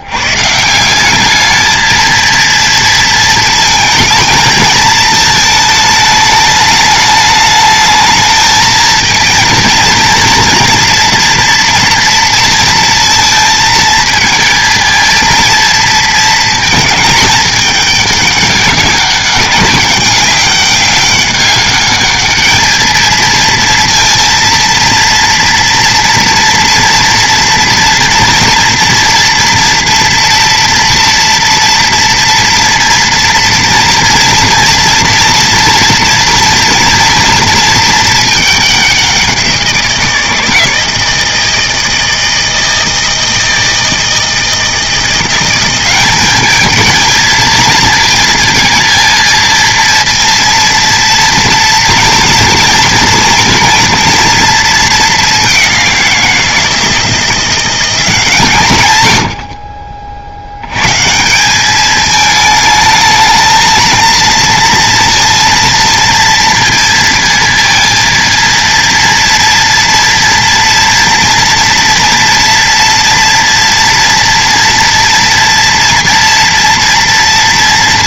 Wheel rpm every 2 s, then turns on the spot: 170, 230, 220, 210, 220, 230, 230, 230, 220, 200, 200, 220, 230, 240, 230, 230, 230, 230, 230, 200, 160, 160, 160, 220, 230, 230, 230, 220, 160, 120, 100, 220, 230, 230, 230, 230, 230, 230, 230.
none